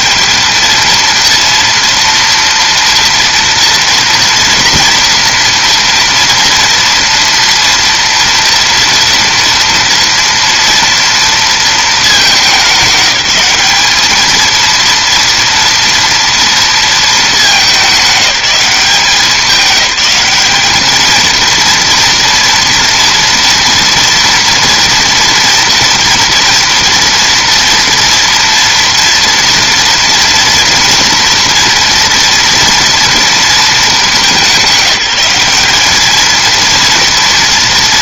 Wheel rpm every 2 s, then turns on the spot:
220, 230, 230, 230, 230, 230, 190, 230, 230, 180, 210, 230, 230, 230, 230, 230, 230, 190, 230.
none